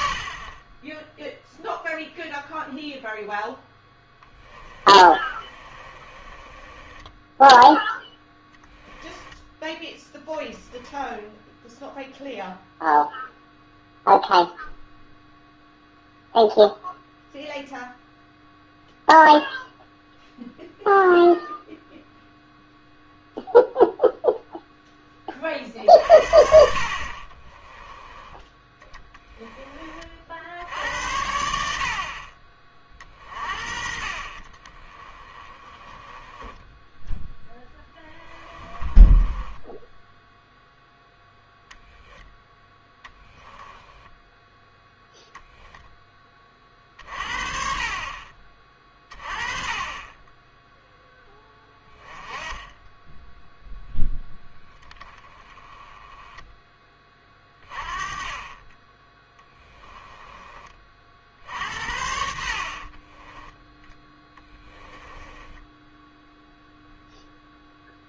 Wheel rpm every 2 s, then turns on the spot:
20, 0, 20, 20, 10, 10, 0, 0, 0, 0, 0, 0, 0, 50, 10, 70, 30, 30, 10, 20, 0, 10, 0, 40, 30, 10, 10, 20, 10, 20, 30, 50, 10, 0.
4-10 34-40 42-44 62-66